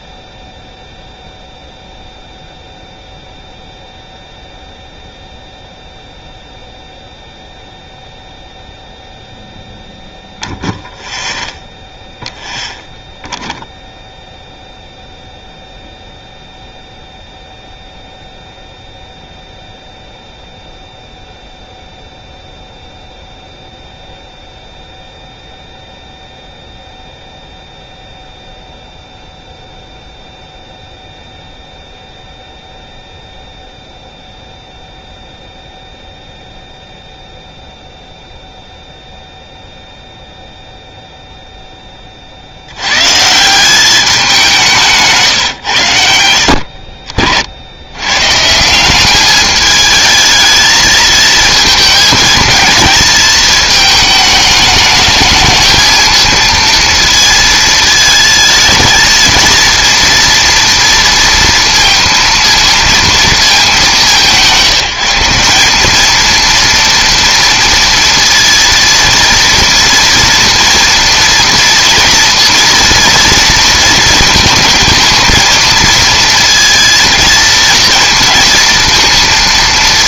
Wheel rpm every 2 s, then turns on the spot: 0, 0, 0, 0, 0, 0, 0, 0, 0, 0, 0, 0, 0, 0, 0, 0, 0, 0, 0, 0, 0, 70, 180, 50, 150, 220, 230, 210, 230, 220, 230, 230, 170, 230, 230, 230, 230, 220, 220, 230.
none